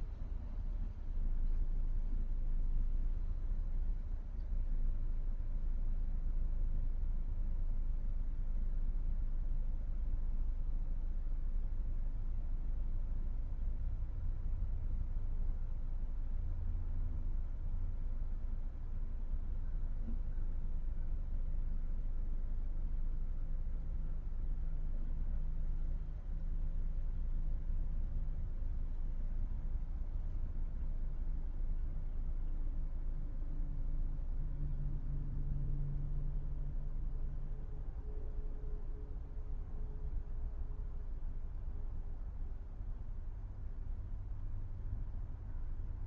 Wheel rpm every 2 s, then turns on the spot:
0, 0, 0, 0, 0, 0, 0, 0, 0, 0, 0, 0, 0, 0, 0, 0, 0, 0, 0, 0, 0, 0, 0.
none